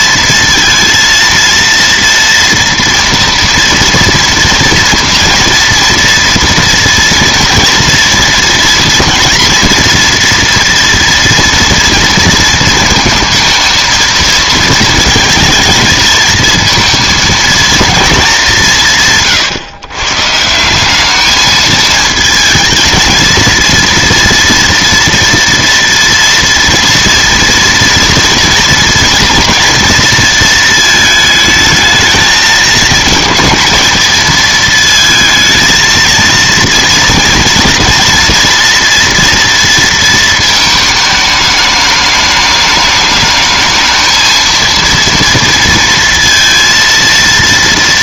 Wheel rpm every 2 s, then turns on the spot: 230, 230, 240, 230, 230, 230, 230, 230, 220, 160, 190, 220, 230, 230, 240, 220, 220, 230, 230, 240, 220, 210, 230, 230.
none